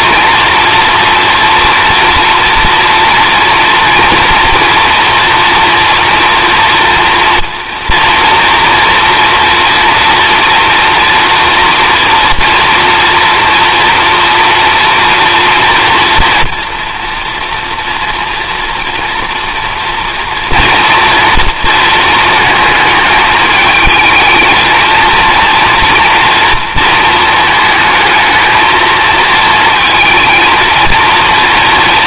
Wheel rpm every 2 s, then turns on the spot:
240, 230, 230, 230, 230, 230, 240, 240, 240, 230, 230, 220, 220, 230, 220, 230.
none